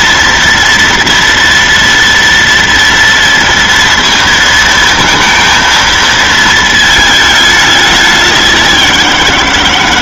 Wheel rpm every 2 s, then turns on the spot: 230, 230, 230, 220, 180.
none